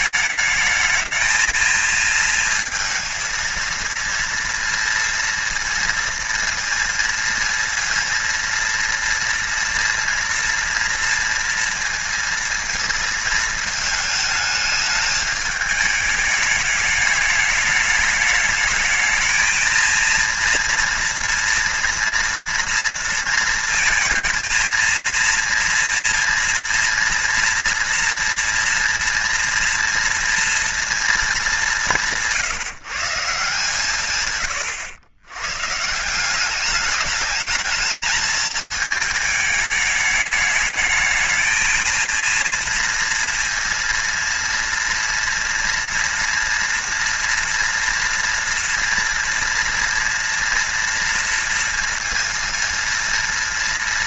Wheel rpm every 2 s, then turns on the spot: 210, 230, 230, 230, 230, 240, 230, 210, 210, 220, 230, 230, 230, 230, 230, 230, 170, 100, 200, 220, 210, 230, 230, 230, 230, 230, 230.
none